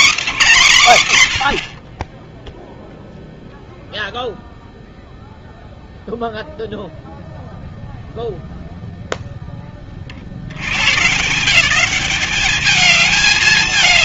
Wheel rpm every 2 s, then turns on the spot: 120, 0, 0, 0, 0, 140, 210.
none